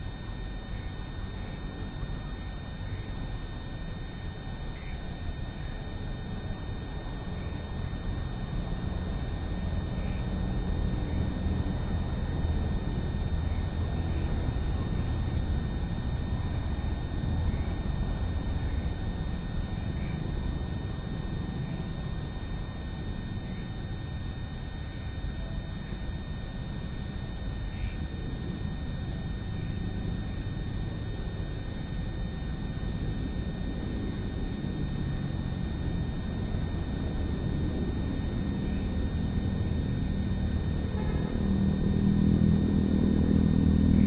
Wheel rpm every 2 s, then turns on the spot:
0, 0, 0, 0, 0, 0, 0, 0, 0, 0, 0, 0, 0, 0, 0, 0, 0, 0, 0, 0, 0, 0.
none